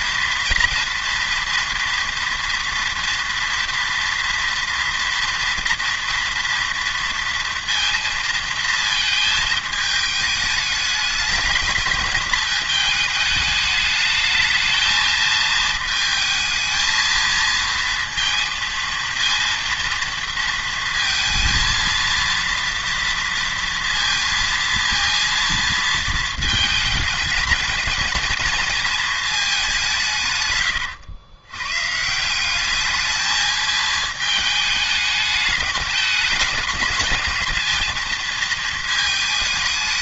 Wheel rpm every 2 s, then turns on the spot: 230, 240, 230, 230, 220, 210, 220, 220, 220, 230, 230, 230, 230, 220, 230, 110, 200, 220, 210, 220.
none